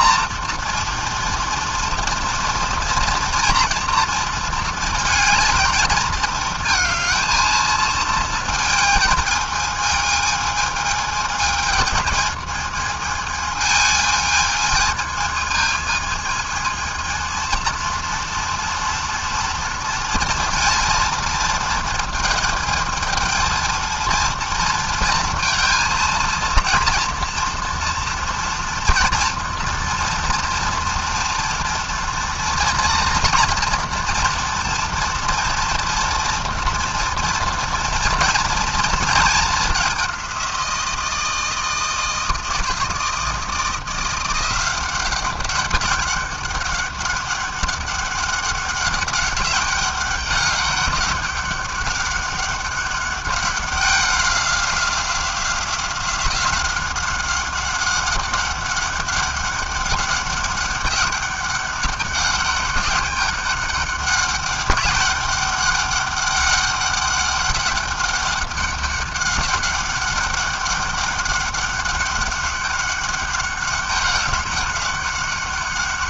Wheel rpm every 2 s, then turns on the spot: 240, 240, 230, 220, 220, 210, 220, 220, 230, 230, 230, 220, 220, 230, 230, 230, 230, 230, 230, 220, 160, 170, 190, 200, 200, 200, 200, 190, 190, 200, 200, 200, 200, 200, 200, 200, 200, 190.
none